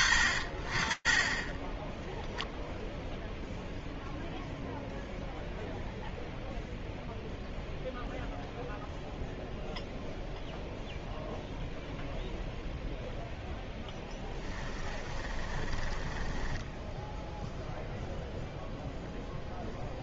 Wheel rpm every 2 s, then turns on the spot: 20, 0, 0, 0, 0, 0, 0, 30, 0, 0.
14-16